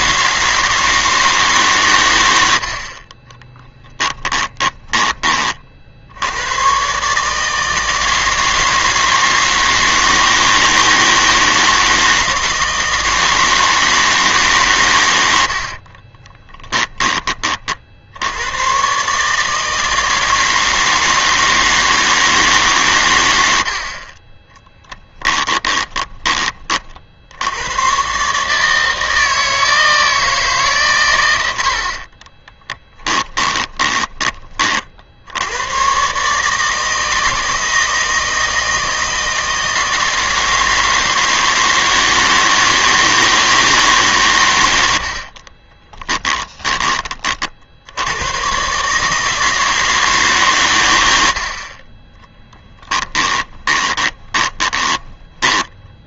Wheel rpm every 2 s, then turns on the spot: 160, 80, 10, 120, 160, 160, 160, 140, 20, 110, 160, 140, 10, 40, 160, 140, 30, 30, 160, 160, 160, 160, 100, 20, 130, 120, 10, 20.
4-6 16-18 24-26 32-34 52-56